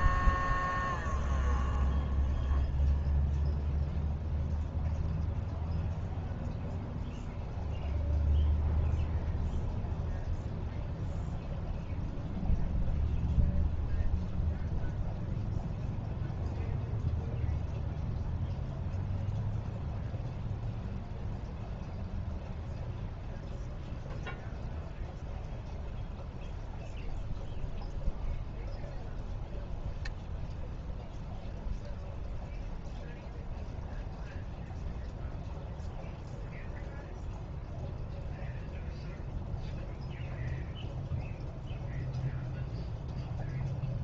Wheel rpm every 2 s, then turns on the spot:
0, 0, 0, 0, 0, 0, 0, 0, 0, 0, 0, 0, 0, 0, 0, 0, 0, 0, 0, 0, 0, 0.
none